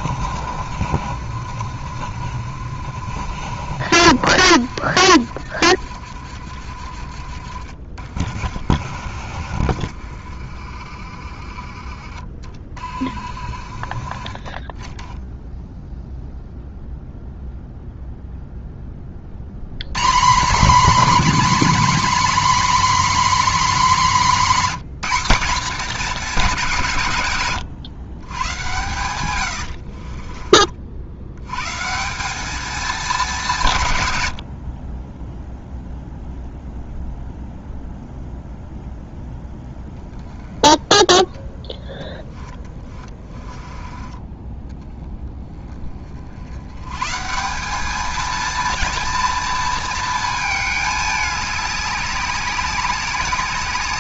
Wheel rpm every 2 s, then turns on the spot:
50, 60, 60, 60, 50, 50, 40, 20, 0, 10, 240, 270, 220, 180, 110, 40, 220, 60, 0, 0, 10, 10, 20, 90, 230, 210, 190.
28-30 42-44